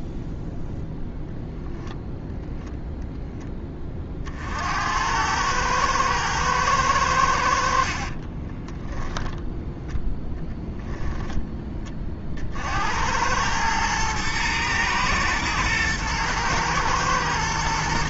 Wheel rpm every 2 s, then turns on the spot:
0, 0, 80, 100, 10, 0, 70, 120, 120.
8-10